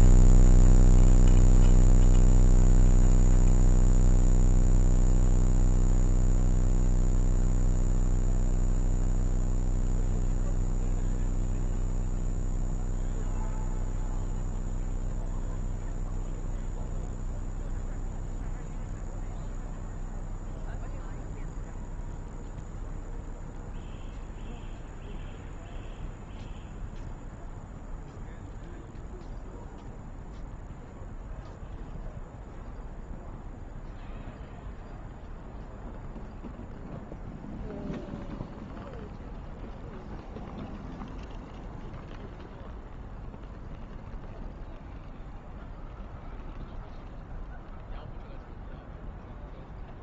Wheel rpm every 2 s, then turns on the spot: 0, 0, 0, 0, 0, 0, 0, 0, 0, 0, 0, 0, 0, 0, 0, 0, 0, 0, 0, 0, 0, 0, 0, 0, 0.
none